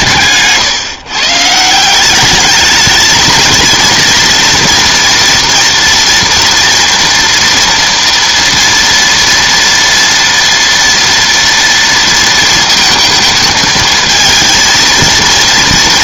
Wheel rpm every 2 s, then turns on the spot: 130, 210, 240, 240, 230, 230, 220, 220.
none